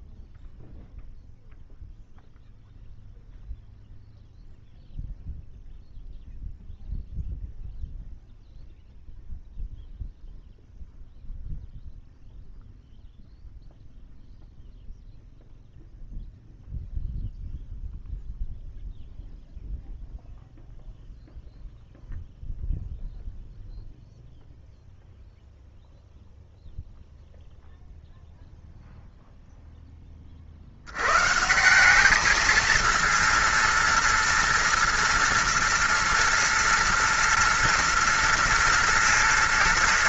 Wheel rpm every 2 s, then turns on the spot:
0, 0, 0, 0, 0, 0, 0, 0, 0, 0, 0, 0, 0, 0, 0, 30, 220, 230, 230, 240.
none